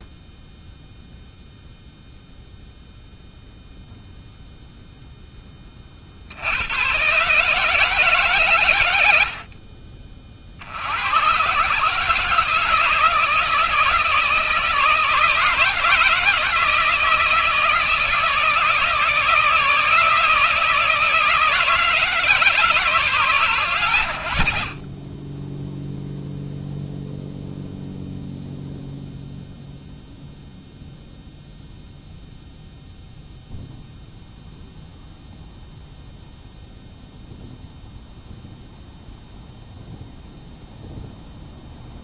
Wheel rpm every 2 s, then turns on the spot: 0, 0, 0, 100, 100, 80, 160, 160, 160, 160, 160, 150, 60, 0, 0, 0, 0, 0, 0, 0, 0.
none